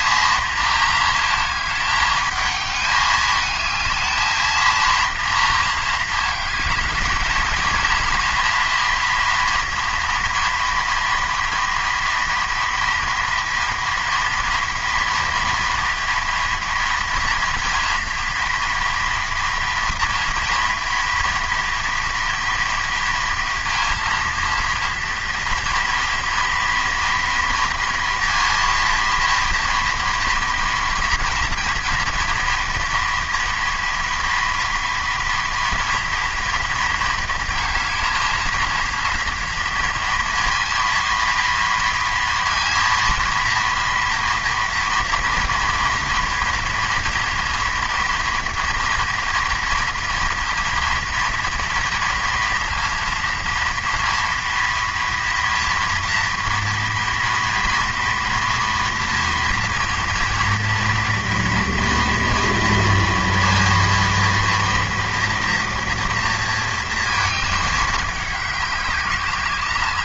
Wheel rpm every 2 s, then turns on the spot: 230, 210, 220, 220, 230, 230, 240, 230, 230, 240, 230, 230, 230, 230, 230, 230, 230, 230, 230, 220, 230, 230, 230, 230, 230, 230, 230, 230, 230, 230, 230, 230, 230, 230, 200.
none